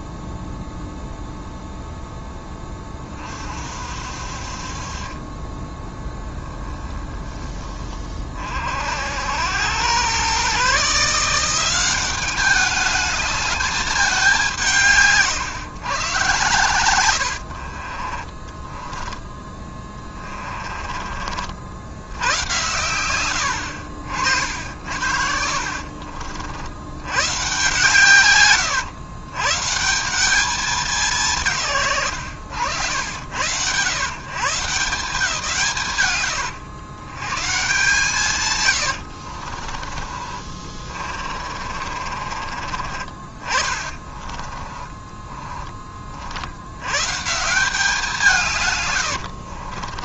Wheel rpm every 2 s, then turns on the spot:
0, 20, 40, 10, 50, 140, 200, 180, 100, 20, 30, 110, 60, 70, 120, 200, 90, 150, 90, 120, 30, 40, 20, 80, 150.
6-8 18-22 24-26 38-42 44-46